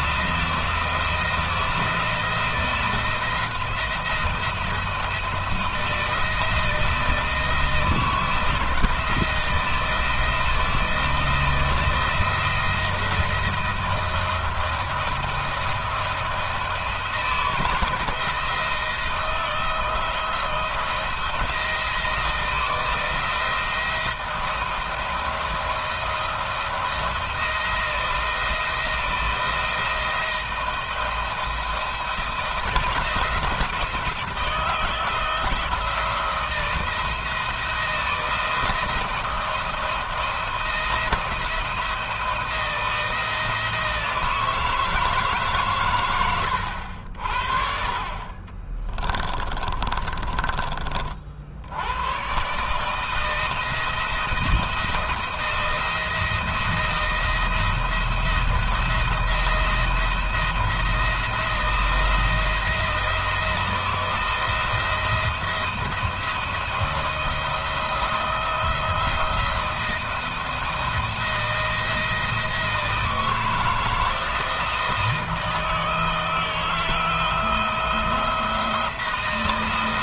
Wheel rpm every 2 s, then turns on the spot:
170, 160, 170, 170, 160, 160, 170, 170, 170, 170, 170, 160, 170, 170, 170, 170, 170, 160, 170, 170, 170, 170, 160, 100, 40, 30, 140, 160, 170, 170, 170, 170, 160, 160, 160, 170, 160, 160, 160, 160.
48-50